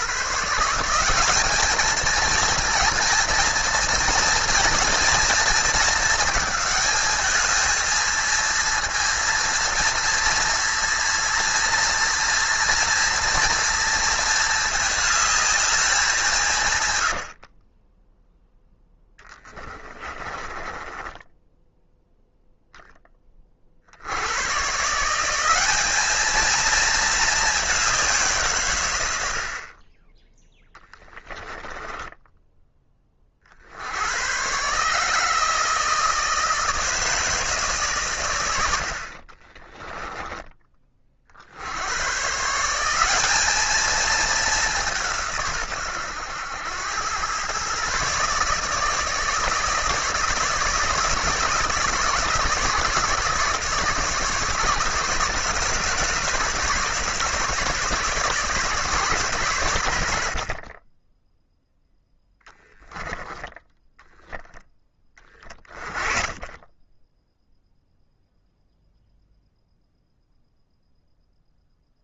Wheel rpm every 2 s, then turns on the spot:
170, 230, 230, 220, 230, 230, 230, 220, 120, 10, 10, 10, 140, 220, 110, 10, 20, 140, 160, 70, 30, 170, 200, 100, 150, 160, 150, 140, 150, 150, 30, 10, 20, 10, 0, 0.
16-18 20-22 62-64